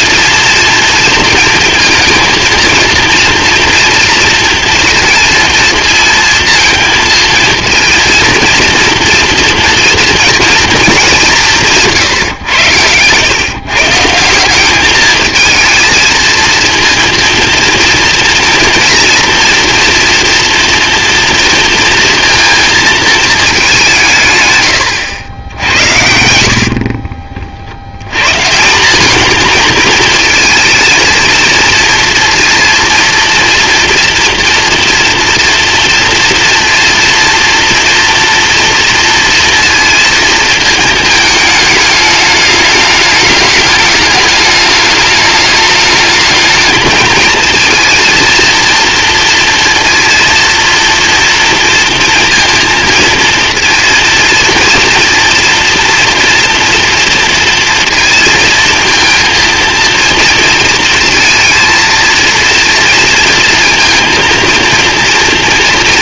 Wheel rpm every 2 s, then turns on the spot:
230, 230, 230, 230, 230, 230, 110, 190, 230, 230, 230, 230, 120, 70, 160, 230, 230, 230, 230, 240, 230, 210, 210, 220, 230, 230, 230, 240, 230, 220, 230, 230, 230.
26-28